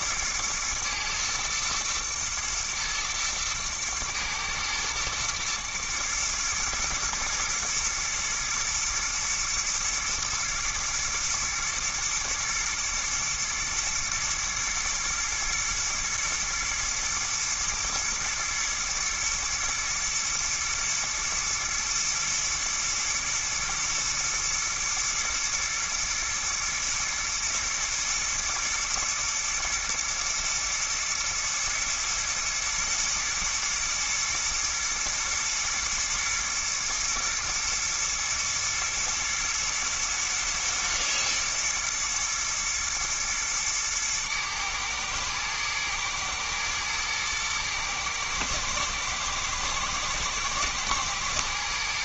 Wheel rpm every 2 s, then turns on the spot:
110, 120, 120, 110, 120, 110, 110, 120, 120, 110, 120, 110, 110, 110, 110, 120, 110, 110, 110, 110, 110, 110, 110, 110, 110, 120.
none